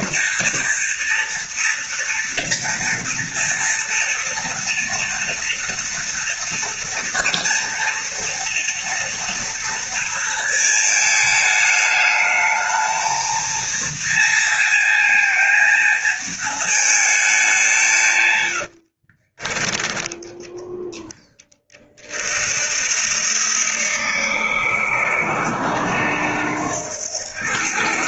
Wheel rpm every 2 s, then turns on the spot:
230, 230, 230, 230, 230, 220, 220, 230, 220, 50, 10, 70, 80, 100.
18-20